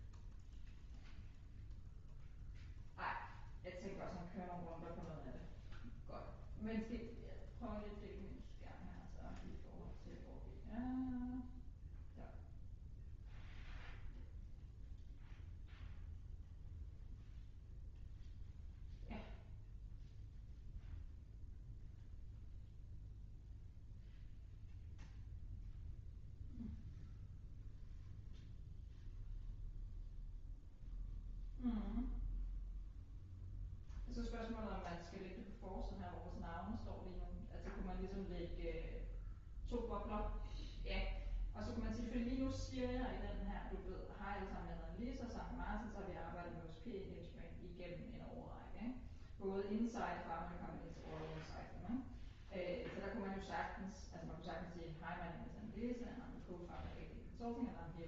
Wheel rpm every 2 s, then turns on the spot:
0, 0, 0, 0, 0, 0, 0, 0, 0, 0, 0, 0, 0, 0, 0, 0, 0, 0, 0, 0, 0, 0, 0, 0, 0, 0, 0, 0, 0.
none